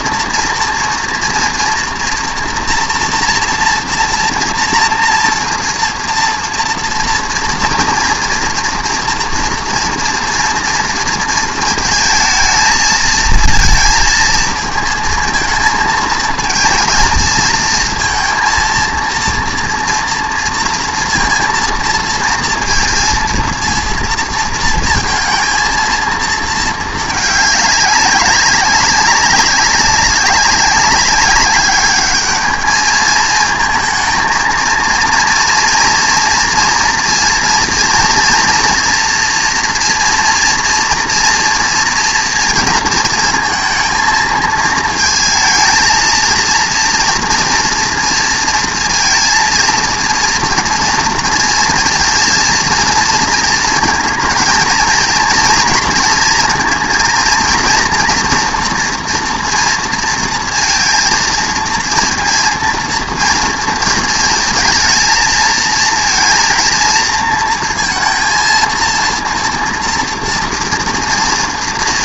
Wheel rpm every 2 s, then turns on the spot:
230, 240, 230, 230, 240, 230, 220, 220, 230, 230, 230, 230, 230, 220, 200, 200, 210, 230, 230, 230, 230, 230, 220, 230, 230, 240, 230, 220, 230, 230, 230, 230, 220, 230, 230, 230.
none